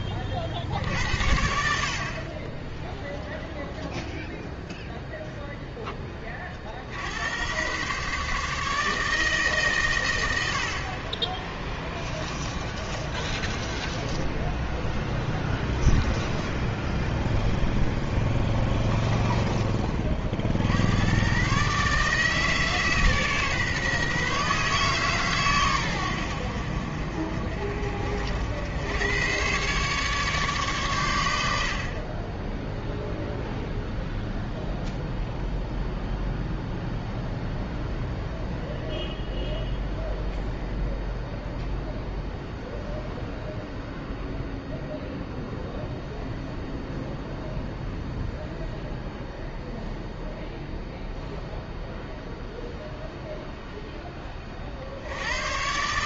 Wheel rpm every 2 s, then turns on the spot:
50, 10, 0, 50, 150, 50, 30, 10, 10, 10, 80, 150, 140, 70, 90, 130, 10, 0, 0, 0, 0, 0, 0, 0, 0, 0, 0, 60.
12-20